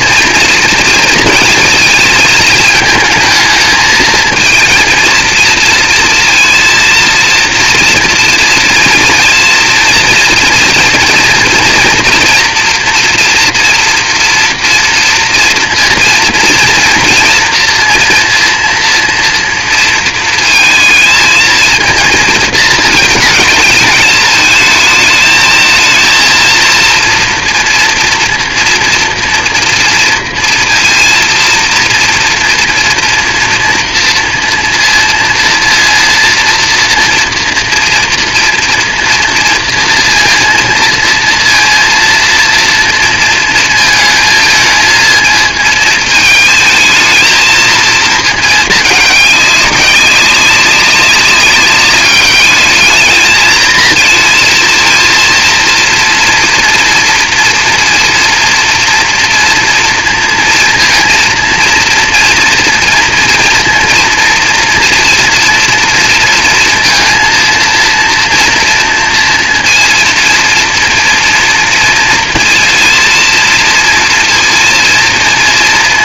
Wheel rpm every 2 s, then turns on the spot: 230, 220, 230, 230, 230, 230, 230, 240, 230, 240, 230, 220, 220, 230, 240, 230, 230, 230, 230, 230, 230, 230, 220, 220, 220, 190, 210, 230, 230, 240, 230, 230, 230, 230, 230, 230, 230, 230.
none